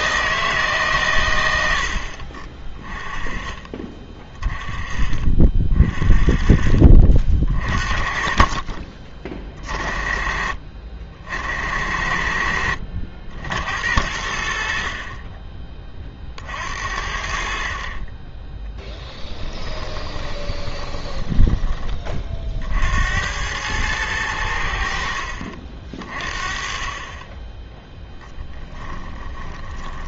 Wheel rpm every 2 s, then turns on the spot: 150, 30, 30, 40, 40, 60, 70, 60, 50, 10, 20, 50, 80, 30, 10.
20-22 28-30